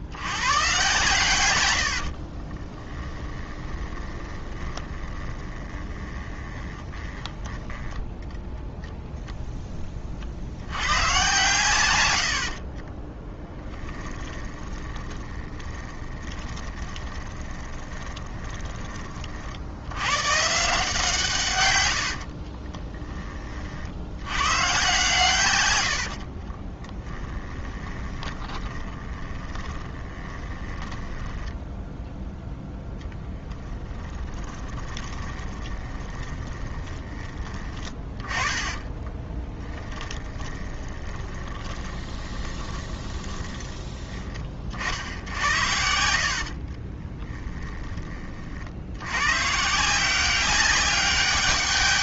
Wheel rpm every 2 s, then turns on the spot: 130, 20, 20, 10, 0, 100, 40, 30, 20, 30, 150, 20, 120, 20, 20, 20, 10, 20, 20, 20, 30, 20, 50, 40, 90, 200.
2-8 12-18 22-24 26-32 34-44 46-48